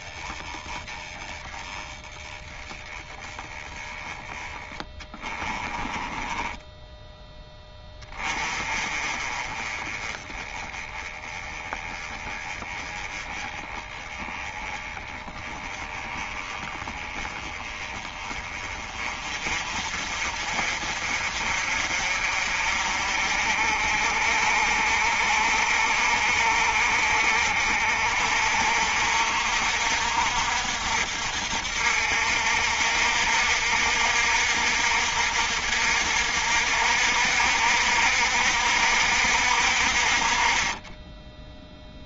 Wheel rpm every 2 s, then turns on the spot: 20, 10, 10, 10, 30, 20, 20, 20, 20, 30, 40, 50, 50, 50, 60, 60, 60, 60, 60, 60, 20.
4-6